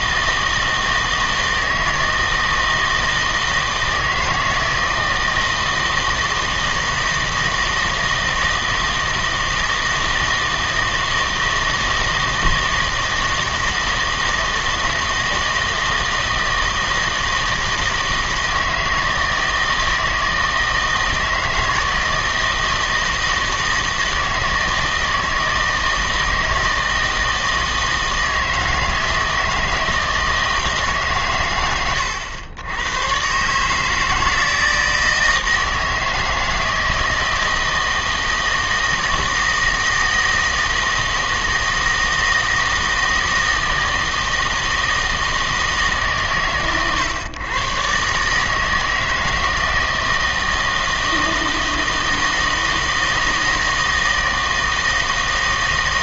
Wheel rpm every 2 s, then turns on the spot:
160, 160, 160, 160, 160, 160, 160, 160, 160, 160, 160, 160, 160, 160, 160, 150, 100, 160, 160, 160, 160, 160, 160, 120, 160, 160, 160, 160.
none